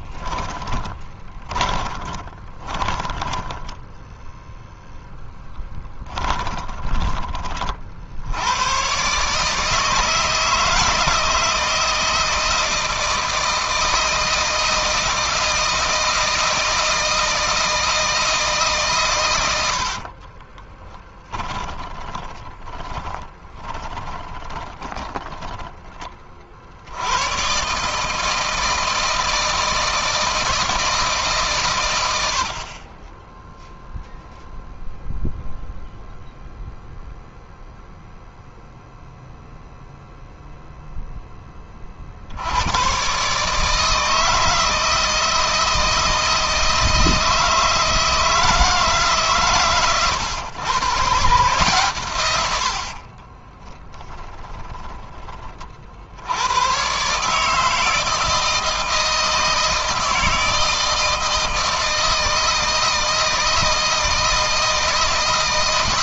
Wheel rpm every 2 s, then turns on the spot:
20, 30, 0, 20, 120, 160, 160, 160, 160, 130, 10, 20, 10, 80, 160, 160, 30, 0, 0, 0, 0, 120, 160, 160, 150, 130, 70, 20, 120, 160, 160, 160, 160.
0-4 20-26 52-54